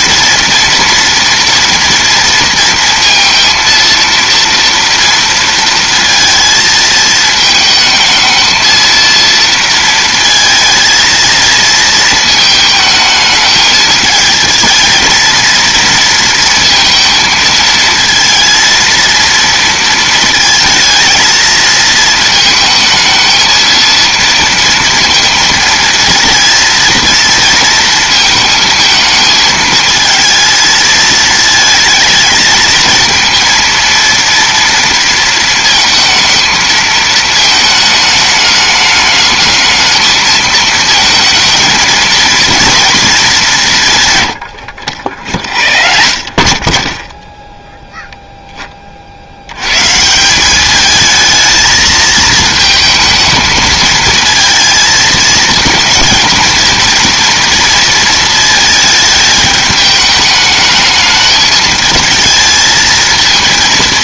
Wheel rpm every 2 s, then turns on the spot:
230, 230, 230, 220, 220, 230, 220, 220, 230, 230, 230, 220, 230, 230, 220, 220, 220, 230, 220, 210, 220, 230, 90, 40, 10, 190, 220, 220, 230, 220, 210, 220.
none